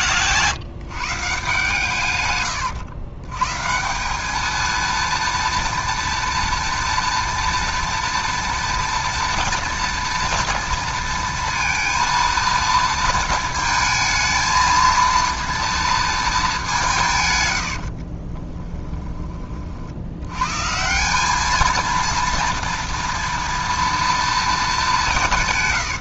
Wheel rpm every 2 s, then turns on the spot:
160, 110, 220, 230, 230, 230, 230, 230, 200, 20, 150, 230, 220.
18-20